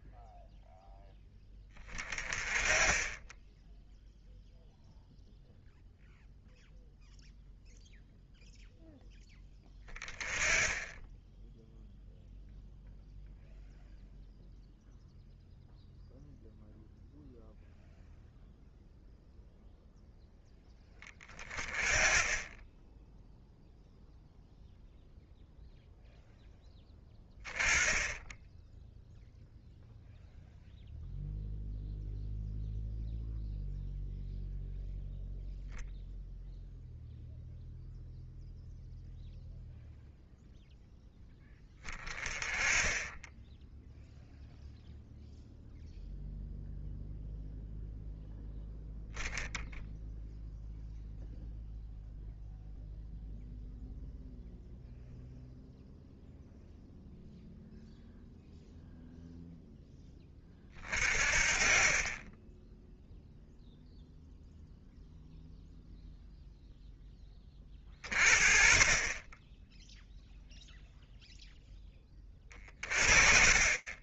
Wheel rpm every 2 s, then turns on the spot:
0, 20, 0, 0, 0, 10, 0, 0, 0, 0, 10, 10, 0, 10, 0, 0, 0, 0, 0, 0, 0, 10, 0, 0, 0, 0, 0, 0, 0, 0, 20, 0, 0, 0, 30, 0, 30.
none